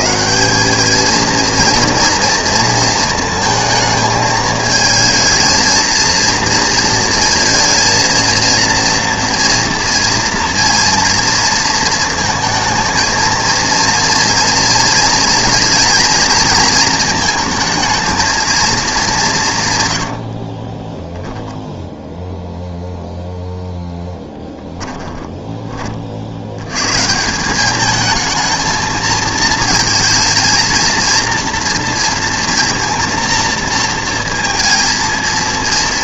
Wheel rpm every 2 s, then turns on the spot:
200, 230, 220, 230, 230, 230, 220, 230, 220, 220, 30, 0, 10, 100, 220, 230, 230, 230.
20-22 24-26